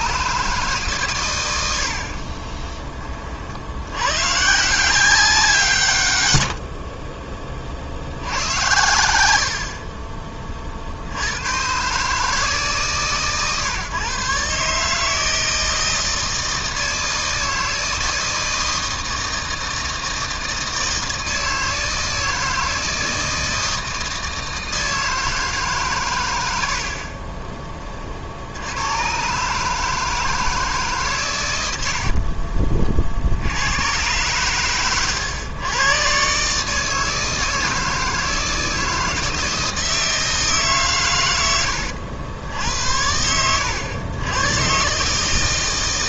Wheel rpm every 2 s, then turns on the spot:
140, 20, 160, 70, 80, 50, 150, 150, 160, 160, 160, 160, 160, 70, 80, 150, 40, 110, 150, 160, 140, 80, 130.
6-8